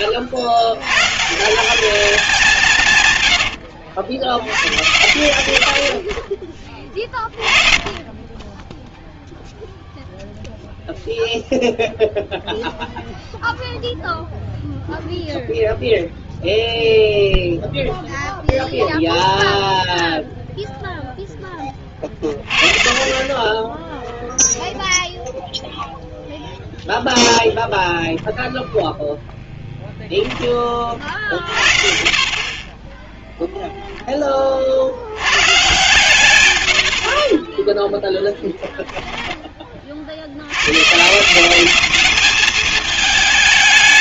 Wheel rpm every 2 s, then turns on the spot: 110, 160, 100, 20, 10, 0, 0, 0, 0, 0, 0, 30, 0, 0, 0, 30, 10, 70, 90, 10, 120, 220.
32-34